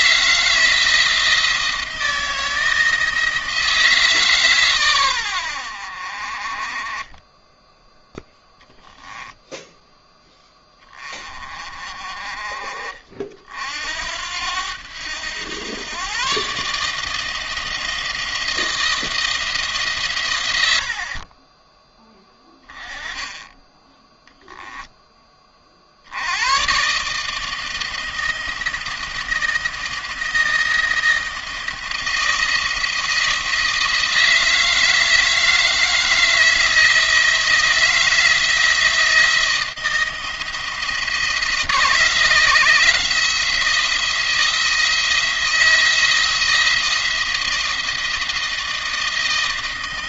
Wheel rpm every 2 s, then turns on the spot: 170, 160, 120, 30, 0, 20, 40, 90, 150, 160, 80, 10, 10, 130, 170, 170, 170, 160, 160, 160, 170, 170, 170, 170, 160.
20-22